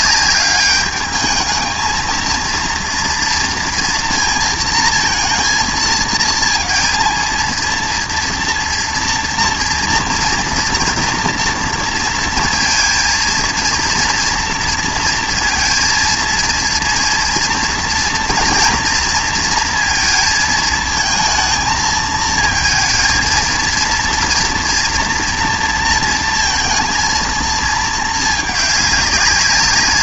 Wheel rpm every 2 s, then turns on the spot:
200, 230, 230, 230, 230, 230, 230, 230, 230, 230, 230, 220, 230, 230, 210.
none